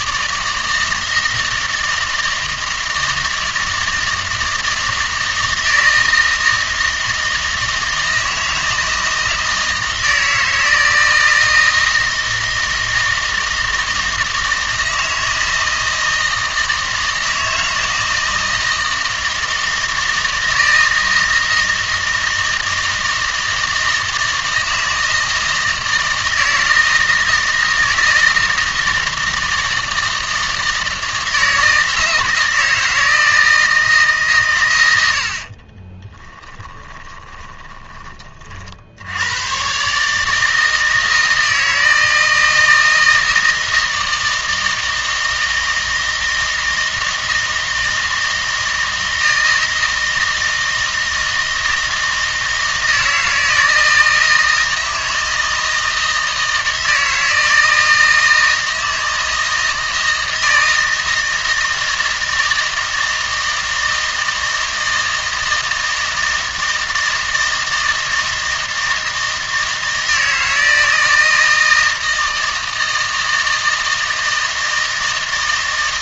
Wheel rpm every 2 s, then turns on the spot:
160, 160, 160, 160, 160, 160, 160, 160, 160, 160, 160, 160, 160, 160, 160, 160, 160, 110, 20, 70, 160, 160, 160, 160, 160, 160, 160, 160, 160, 160, 160, 160, 160, 160, 160, 160, 160, 160.
36-38